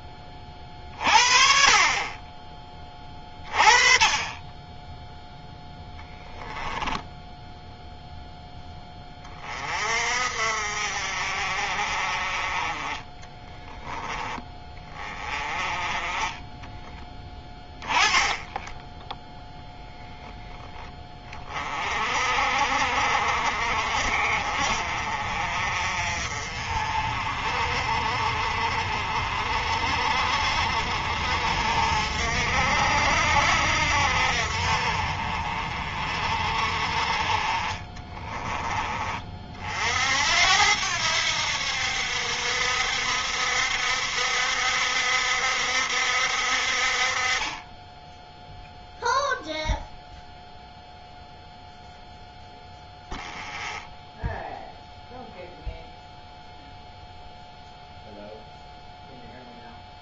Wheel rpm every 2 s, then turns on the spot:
40, 20, 10, 10, 20, 50, 30, 20, 20, 10, 10, 50, 40, 40, 40, 50, 60, 40, 40, 30, 80, 60, 70, 40, 0, 0, 0, 0, 0, 0.
none